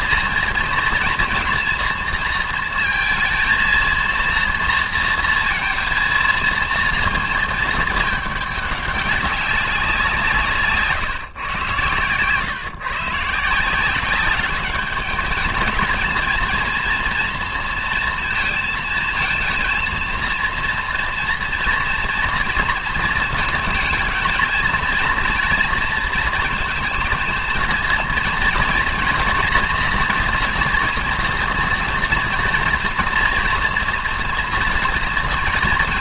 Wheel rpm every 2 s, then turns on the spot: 230, 230, 230, 230, 210, 160, 140, 210, 230, 230, 230, 230, 230, 230, 230, 230, 230, 230.
none